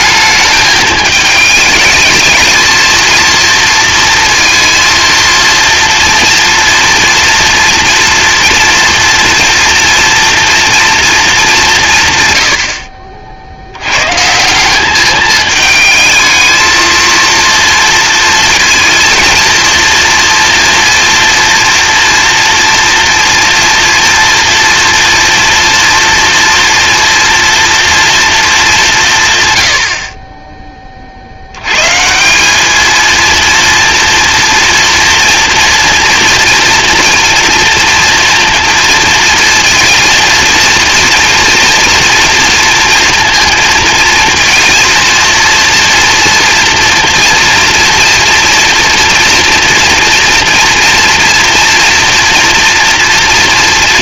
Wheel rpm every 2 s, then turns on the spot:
210, 230, 230, 240, 230, 220, 50, 210, 230, 220, 230, 230, 240, 230, 160, 40, 220, 230, 230, 230, 230, 230, 230, 240, 230, 240, 230.
none